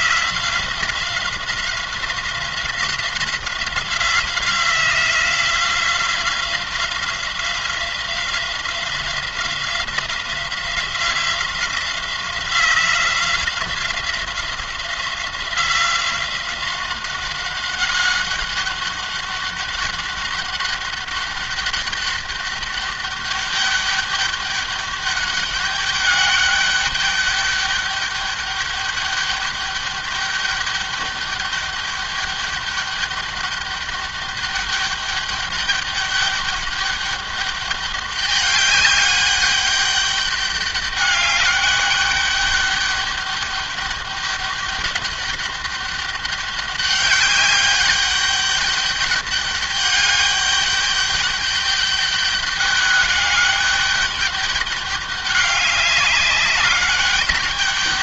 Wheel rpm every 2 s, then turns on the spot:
180, 180, 180, 180, 180, 180, 180, 180, 190, 200, 200, 200, 200, 200, 200, 200, 200, 200, 200, 200, 200, 200, 200, 200, 200, 200, 200, 200, 200.
none